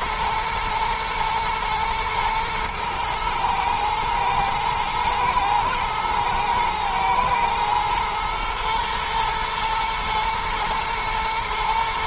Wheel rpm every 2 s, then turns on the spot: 110, 110, 120, 110, 110, 110.
none